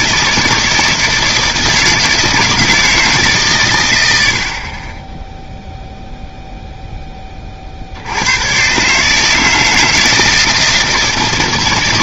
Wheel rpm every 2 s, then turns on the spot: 160, 160, 30, 0, 130, 160.
none